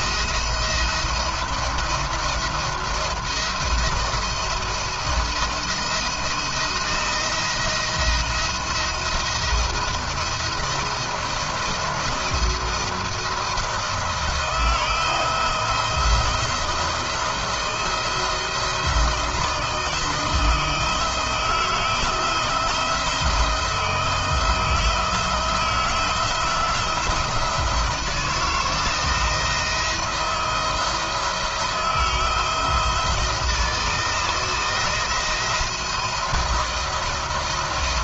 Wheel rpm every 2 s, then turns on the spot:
170, 160, 170, 170, 170, 160, 170, 170, 160, 170, 160, 170, 170, 160, 160, 160, 160, 170, 170.
none